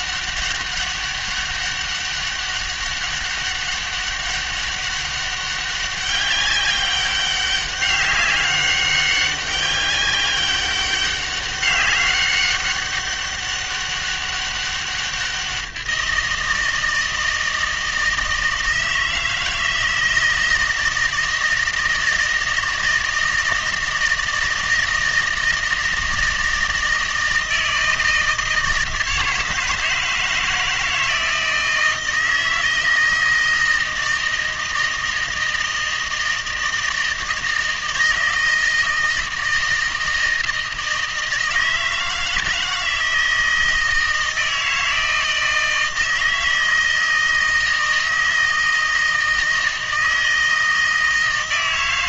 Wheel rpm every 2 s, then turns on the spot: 200, 200, 200, 200, 200, 200, 200, 200, 170, 160, 160, 160, 160, 160, 160, 160, 160, 160, 160, 160, 160, 160, 160, 160, 160, 160.
none